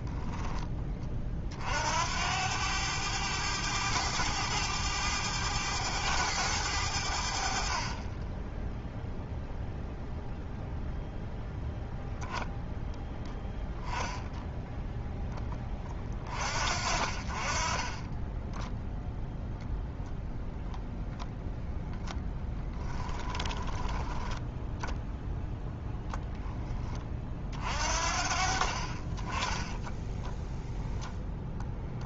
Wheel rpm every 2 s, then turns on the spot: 20, 100, 100, 90, 0, 0, 0, 0, 40, 0, 0, 20, 0, 10, 40, 0.
22-24